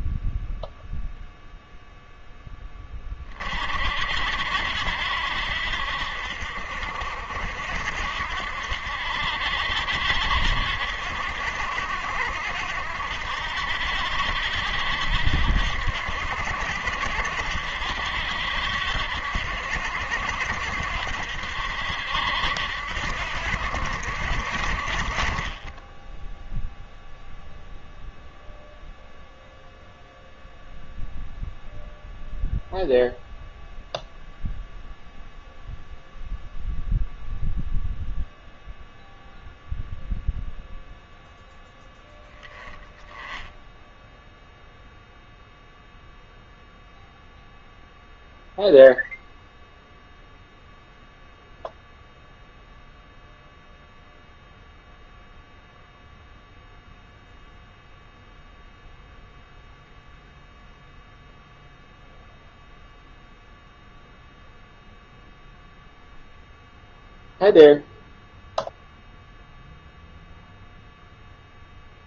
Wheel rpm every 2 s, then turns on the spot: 0, 20, 60, 60, 70, 70, 70, 60, 70, 70, 60, 60, 40, 0, 0, 0, 0, 0, 0, 0, 0, 10, 0, 0, 0, 0, 0, 0, 0, 0, 0, 0, 0, 0, 0, 0.
none